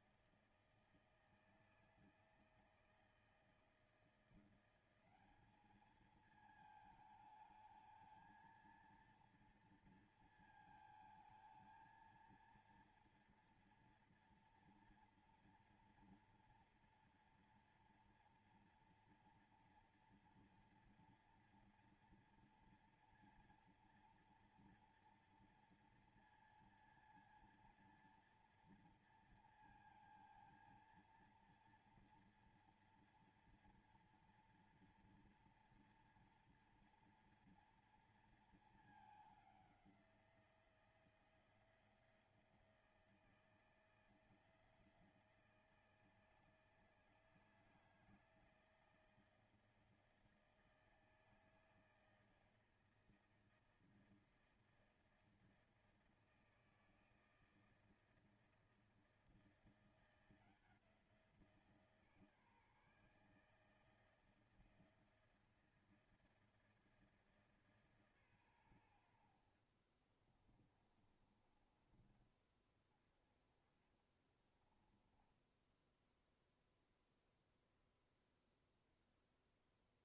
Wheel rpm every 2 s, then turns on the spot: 160, 160, 170, 220, 220, 230, 230, 240, 230, 230, 240, 230, 230, 230, 230, 230, 230, 240, 230, 230, 180, 170, 170, 160, 160, 160, 160, 160, 160, 160, 170, 150, 160, 160, 140, 40, 20, 20, 10, 0.
70-72 74-78